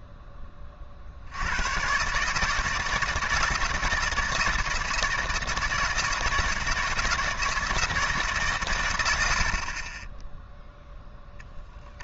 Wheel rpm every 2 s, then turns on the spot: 30, 150, 170, 160, 140, 0.
none